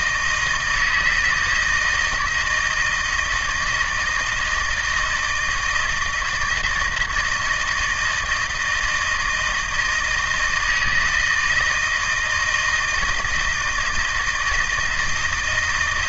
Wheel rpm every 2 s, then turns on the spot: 160, 170, 160, 160, 160, 160, 160, 160.
none